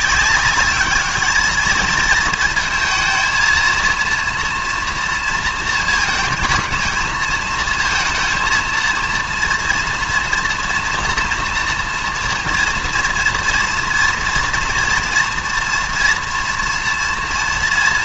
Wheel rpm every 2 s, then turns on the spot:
200, 230, 230, 220, 230, 230, 230, 230, 230.
none